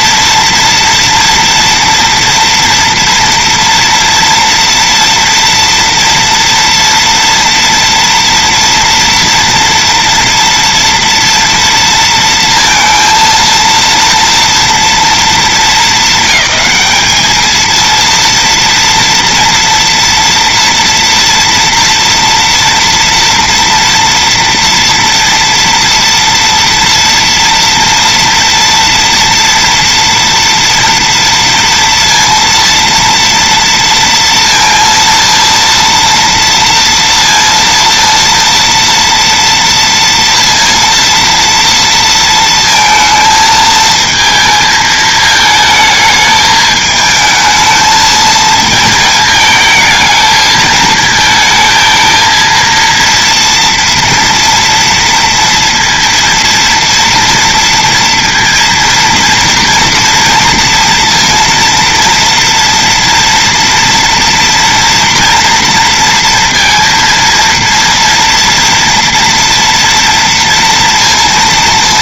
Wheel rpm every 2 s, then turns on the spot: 230, 240, 230, 230, 230, 240, 230, 230, 200, 230, 230, 230, 230, 230, 230, 230, 230, 230, 230, 230, 230, 220, 220, 220, 220, 220, 230, 230, 230, 230, 230, 230, 240, 230, 230, 230.
none